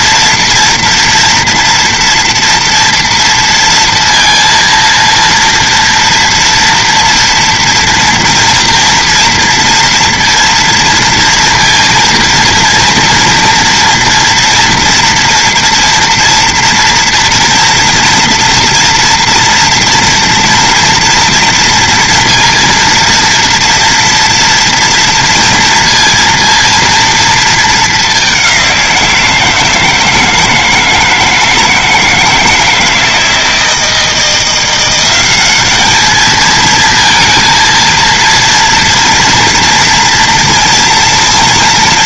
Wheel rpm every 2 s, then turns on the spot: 240, 230, 230, 230, 230, 230, 230, 240, 230, 230, 230, 230, 230, 230, 200, 160, 160, 170, 210, 230, 230.
none